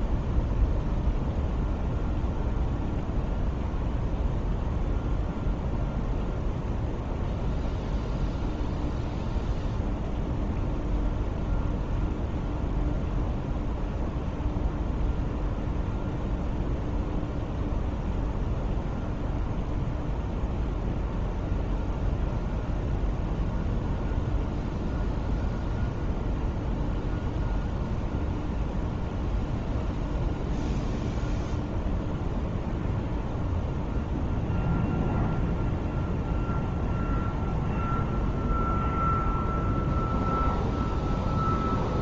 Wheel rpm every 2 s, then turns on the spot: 0, 0, 0, 0, 0, 0, 0, 0, 0, 0, 0, 0, 0, 0, 0, 0, 0, 0, 0, 0, 0.
none